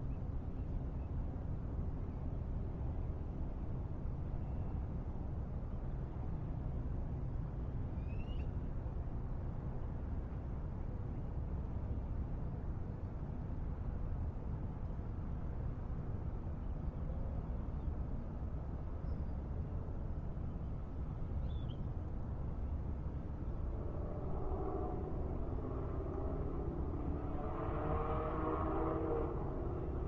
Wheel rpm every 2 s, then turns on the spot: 0, 0, 0, 0, 0, 0, 0, 0, 0, 0, 0, 0, 0, 0, 0.
none